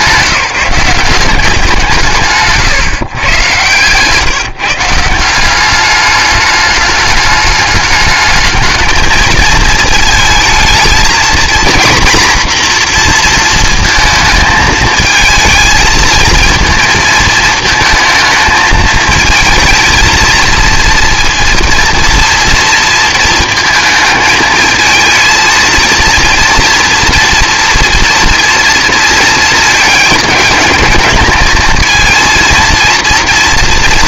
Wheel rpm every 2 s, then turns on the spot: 180, 160, 150, 210, 220, 220, 240, 220, 230, 220, 230, 230, 220, 230, 230, 220, 230.
2-4